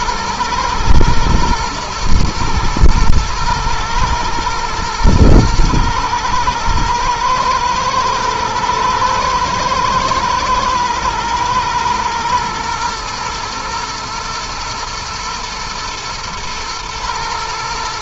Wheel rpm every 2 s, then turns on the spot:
110, 110, 120, 110, 120, 110, 120, 120, 120.
none